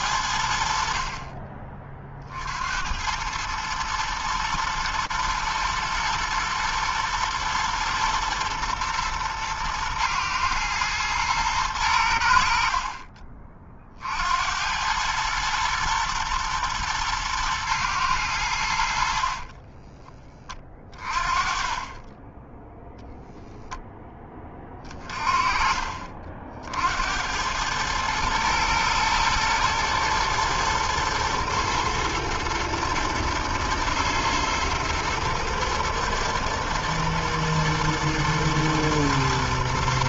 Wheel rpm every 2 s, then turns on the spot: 80, 60, 110, 110, 110, 110, 70, 70, 120, 90, 20, 10, 20, 50, 110, 120, 120, 120, 120, 110.
none